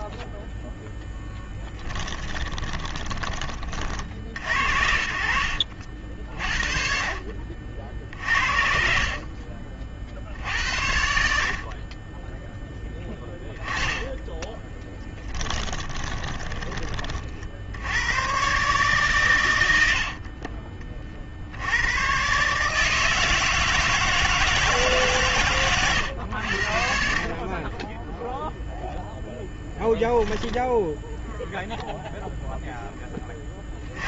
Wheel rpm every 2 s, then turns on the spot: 10, 20, 60, 40, 60, 70, 10, 20, 30, 130, 40, 150, 160, 60, 0, 10, 0.
2-4 8-10 14-18 30-32